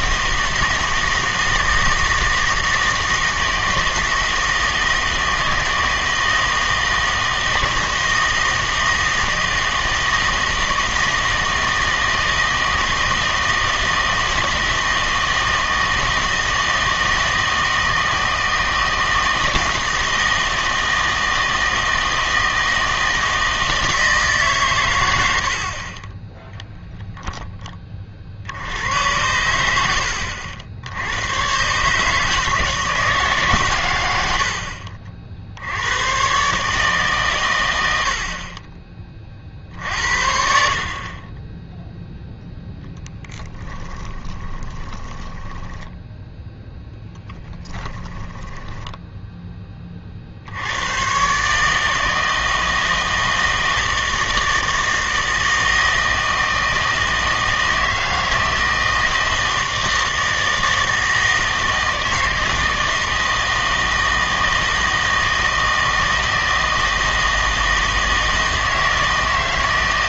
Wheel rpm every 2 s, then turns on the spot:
160, 160, 160, 160, 160, 160, 160, 160, 160, 160, 160, 160, 140, 0, 70, 70, 160, 60, 140, 30, 60, 0, 20, 0, 10, 90, 160, 160, 160, 160, 160, 160, 160, 160, 160.
44-46 48-50